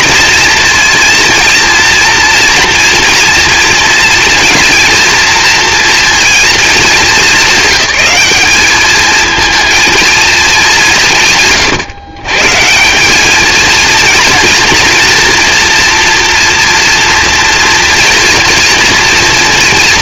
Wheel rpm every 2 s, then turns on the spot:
230, 230, 230, 220, 220, 170, 190, 240, 240, 220.
none